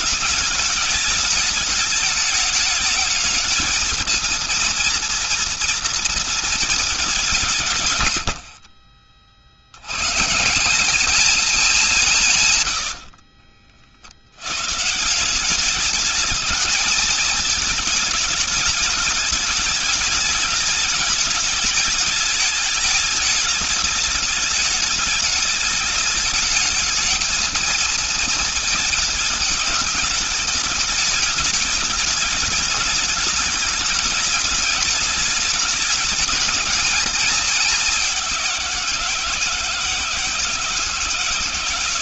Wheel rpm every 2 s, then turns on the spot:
210, 210, 240, 210, 50, 190, 80, 140, 220, 210, 210, 210, 210, 220, 220, 210, 210, 210, 210, 180, 160.
12-14